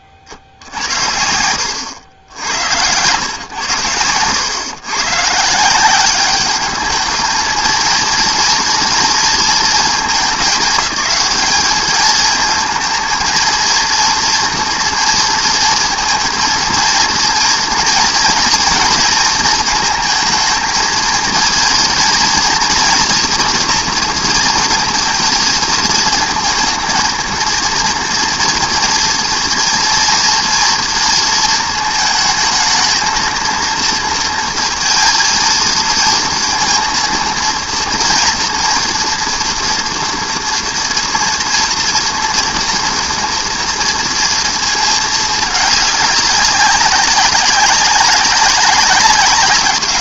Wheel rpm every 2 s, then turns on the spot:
40, 90, 110, 210, 230, 200, 220, 230, 230, 230, 230, 240, 230, 220, 230, 230, 220, 230, 230, 240, 230, 230, 230, 200, 190.
none